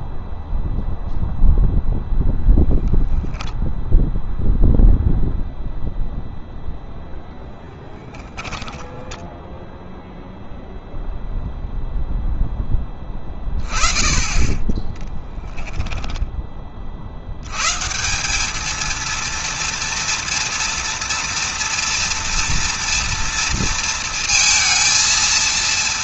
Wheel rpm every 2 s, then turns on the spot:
0, 10, 0, 0, 10, 0, 20, 10, 100, 230, 230, 230, 230.
14-16